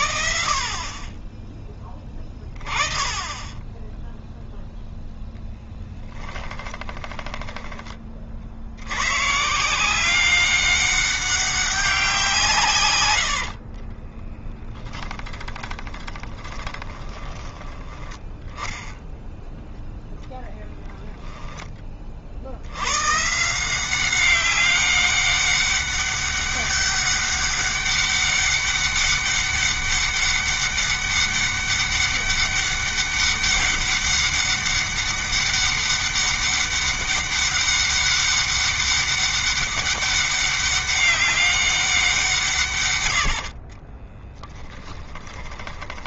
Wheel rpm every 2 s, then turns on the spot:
30, 20, 0, 20, 90, 200, 130, 10, 10, 10, 0, 90, 200, 200, 200, 200, 200, 200, 200, 200, 200, 150, 20.
6-8 12-14 16-18 42-46